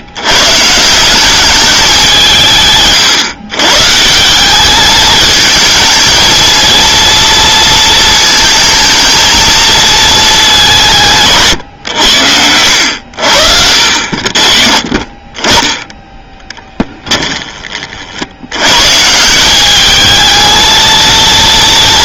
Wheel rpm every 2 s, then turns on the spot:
140, 150, 200, 230, 220, 200, 80, 50, 10, 90, 220.
14-18